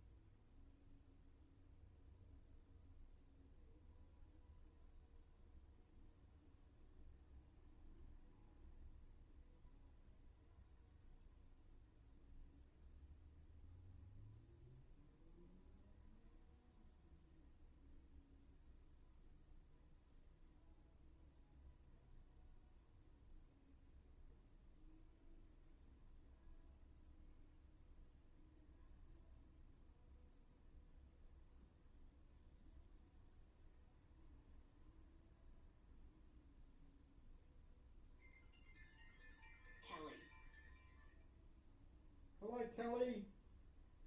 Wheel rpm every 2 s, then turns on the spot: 0, 0, 0, 0, 0, 0, 0, 0, 0, 0, 0, 0, 0, 0, 0, 0, 0, 0, 0, 0, 0, 0.
none